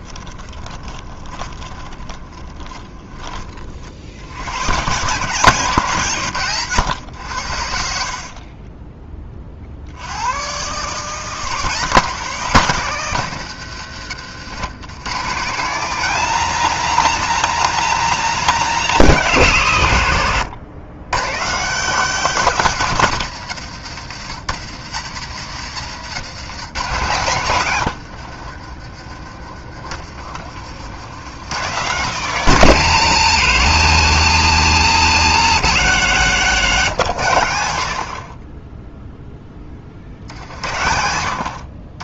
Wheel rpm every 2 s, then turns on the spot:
20, 10, 100, 130, 30, 130, 170, 120, 210, 200, 110, 180, 90, 130, 50, 70, 170, 160, 150, 20, 80.
0-4 8-10 28-30 36-38